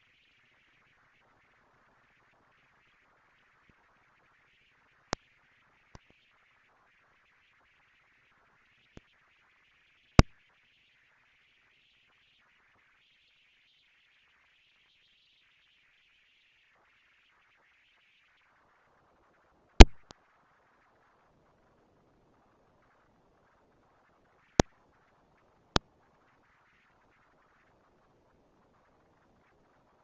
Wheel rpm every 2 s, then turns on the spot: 220, 230, 230, 230, 220, 220, 220, 220, 220, 230, 230, 220, 230, 240, 230.
none